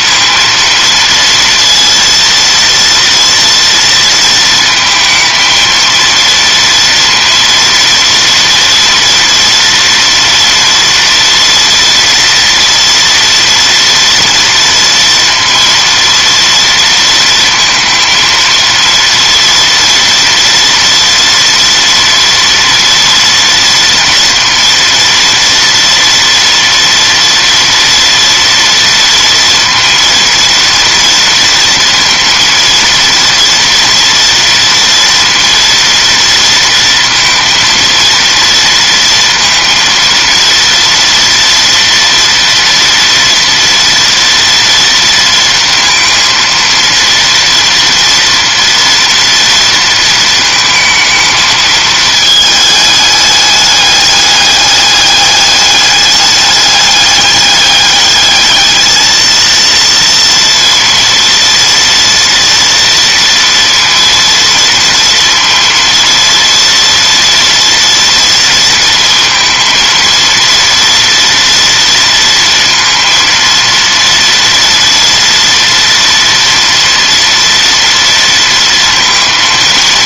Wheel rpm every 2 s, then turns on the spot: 230, 230, 230, 230, 230, 230, 230, 230, 230, 230, 230, 230, 230, 230, 230, 230, 230, 230, 230, 230, 230, 230, 230, 230, 230, 220, 210, 210, 200, 220, 230, 230, 230, 230, 230, 230, 230, 230, 230, 230.
none